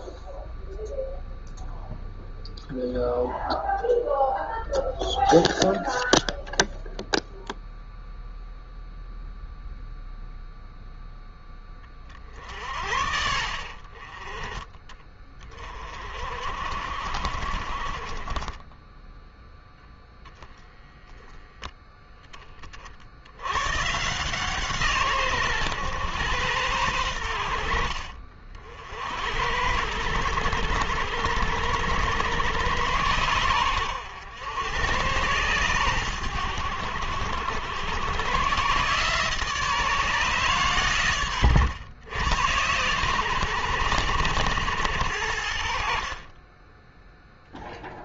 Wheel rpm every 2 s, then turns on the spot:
0, 0, 0, 0, 0, 0, 50, 20, 50, 10, 0, 40, 140, 90, 60, 80, 100, 100, 90, 130, 130, 110, 80, 10.
none